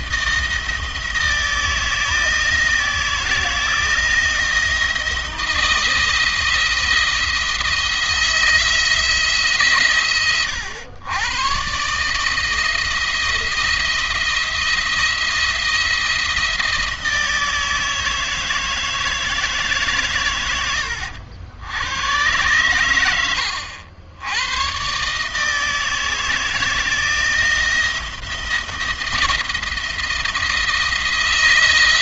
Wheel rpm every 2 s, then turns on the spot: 160, 160, 160, 170, 170, 110, 160, 170, 160, 160, 80, 90, 130, 160, 170, 160.
22-24